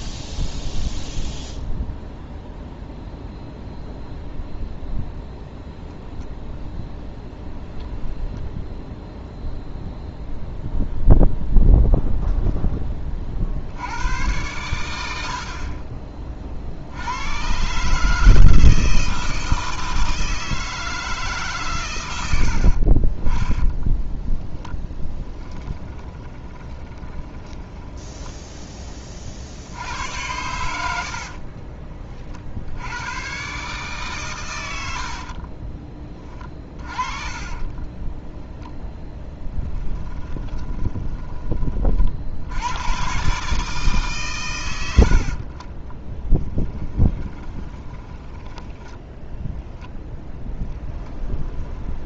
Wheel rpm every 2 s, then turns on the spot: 0, 0, 0, 0, 0, 0, 0, 100, 60, 160, 160, 70, 10, 20, 10, 90, 70, 100, 30, 0, 20, 90, 110, 10, 10, 10.
22-28 36-38 40-42 46-48 50-52